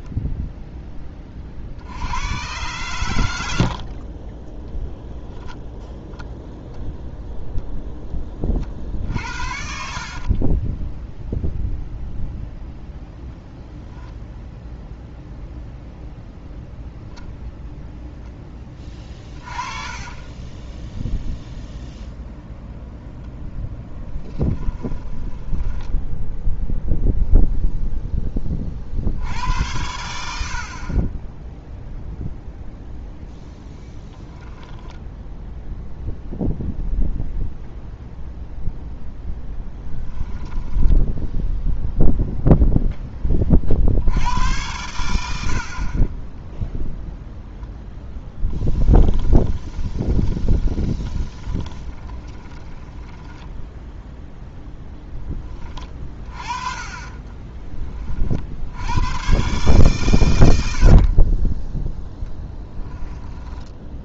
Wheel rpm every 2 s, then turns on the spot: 10, 120, 10, 0, 50, 10, 0, 0, 0, 20, 10, 0, 20, 0, 40, 50, 0, 0, 0, 0, 10, 0, 90, 0, 10, 30, 20, 0, 30, 70, 70, 0.
10-12 20-22 24-26 40-42 48-54 56-58